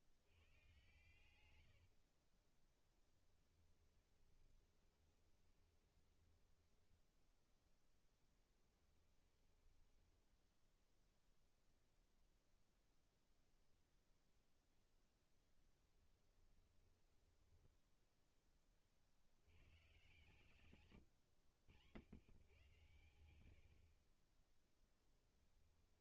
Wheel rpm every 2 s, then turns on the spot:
120, 10, 20, 10, 10, 0, 0, 0, 10, 60, 120, 110, 10.
2-6 8-10 16-18 24-26